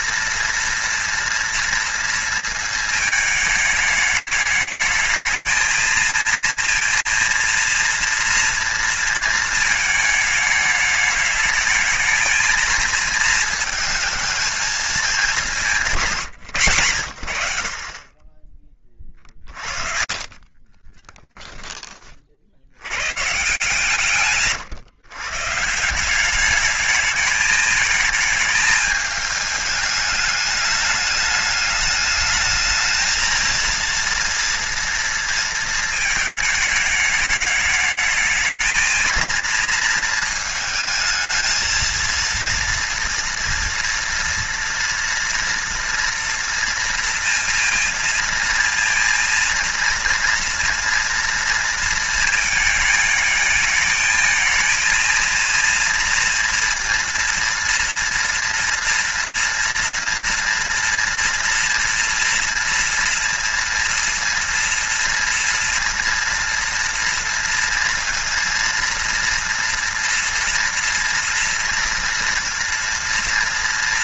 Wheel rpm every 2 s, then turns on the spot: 230, 220, 210, 230, 230, 210, 220, 220, 120, 20, 30, 80, 130, 210, 220, 210, 220, 230, 210, 220, 220, 230, 230, 230, 230, 230, 220, 230, 230, 230, 230, 230, 230, 230, 230, 230, 240.
18-22